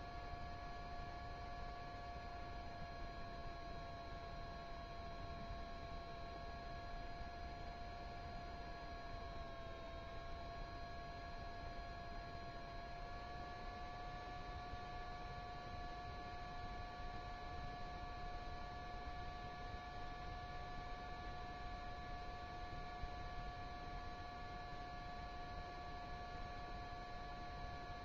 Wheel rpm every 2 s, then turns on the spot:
0, 0, 0, 0, 0, 0, 0, 0, 0, 0, 0, 0, 0, 0.
none